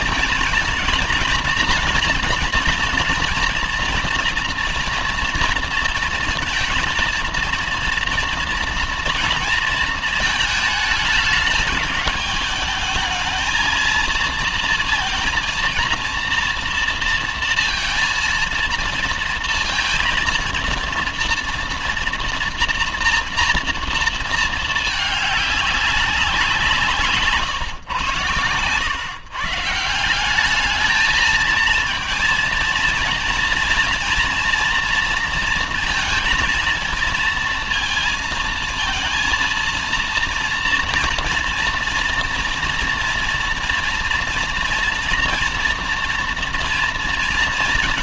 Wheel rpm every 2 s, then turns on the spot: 230, 240, 240, 230, 230, 220, 220, 230, 230, 230, 230, 230, 220, 180, 120, 200, 230, 230, 230, 220, 230, 230, 230, 230.
none